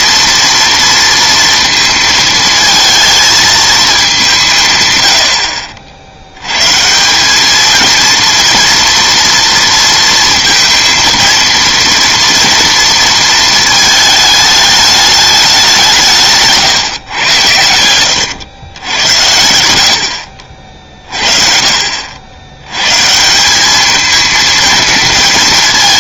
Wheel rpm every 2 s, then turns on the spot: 230, 220, 140, 120, 230, 230, 230, 210, 140, 100, 50, 100, 230.
16-18